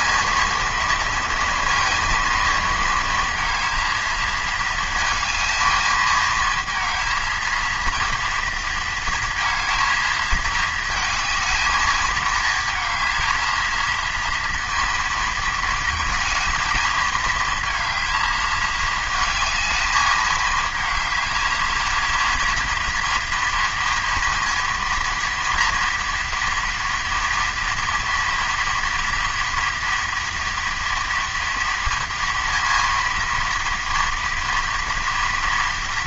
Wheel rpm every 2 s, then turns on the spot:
230, 230, 220, 220, 230, 220, 220, 230, 230, 220, 210, 230, 230, 230, 230, 230, 230, 230.
none